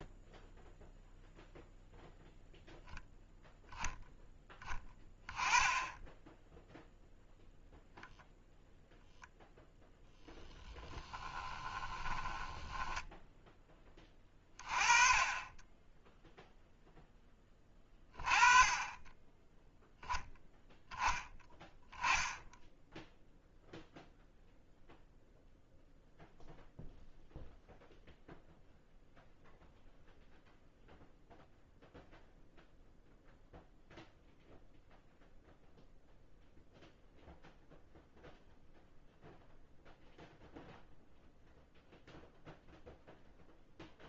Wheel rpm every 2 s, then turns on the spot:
0, 0, 10, 10, 0, 10, 10, 30, 0, 20, 0, 0, 0, 0, 0, 0, 0, 0, 0, 0, 0, 0.
10-14